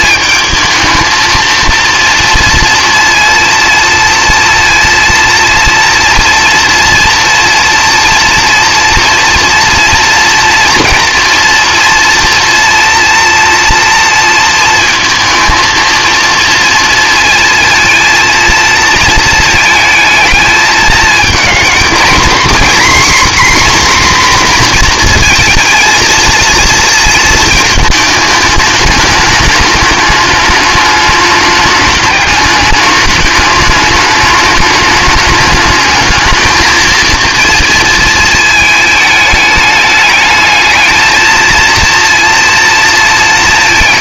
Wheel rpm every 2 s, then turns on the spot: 220, 230, 230, 230, 230, 240, 230, 230, 230, 230, 220, 260, 240, 230, 210, 210, 210, 210, 220, 220, 220, 220.
none